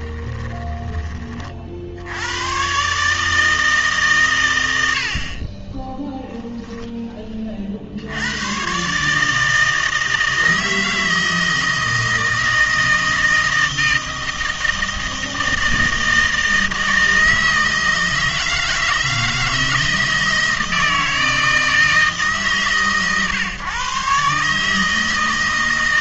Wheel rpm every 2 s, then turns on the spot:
20, 120, 90, 10, 130, 160, 160, 160, 160, 160, 160, 130, 150.
0-2